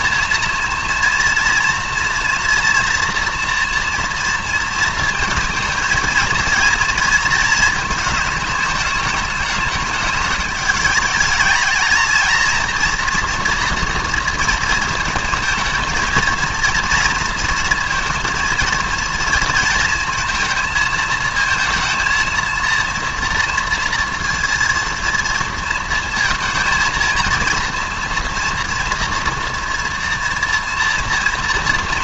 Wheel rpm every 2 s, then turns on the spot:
230, 230, 230, 230, 220, 210, 230, 230, 230, 230, 220, 220, 230, 230, 230, 230.
none